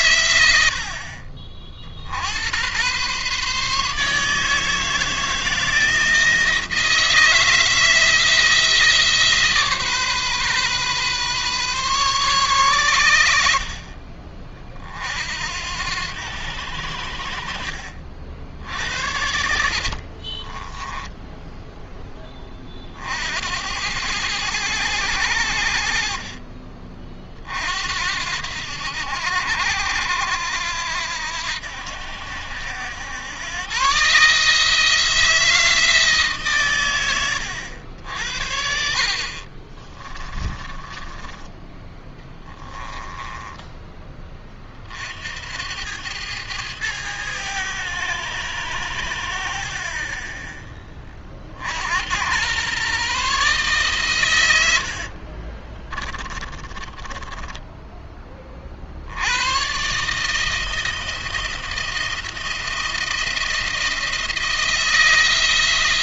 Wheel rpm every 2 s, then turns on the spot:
80, 100, 160, 160, 160, 130, 120, 50, 80, 70, 20, 30, 100, 30, 80, 80, 80, 150, 130, 60, 30, 10, 30, 100, 90, 10, 110, 90, 20, 40, 160, 170, 170.
20-22 40-44 56-58